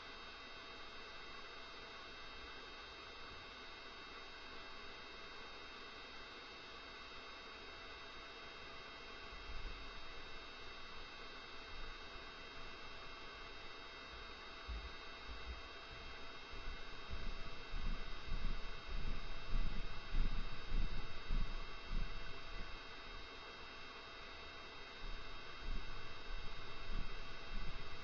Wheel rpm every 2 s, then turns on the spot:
0, 0, 0, 0, 0, 0, 0, 0, 0, 0, 0, 0, 0, 0.
none